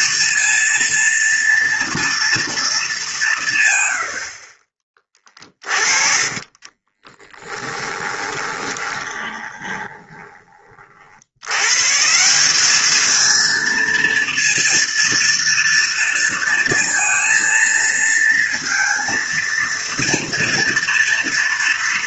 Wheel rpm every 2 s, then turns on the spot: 230, 220, 30, 30, 20, 40, 200, 230, 230, 230, 230.
6-10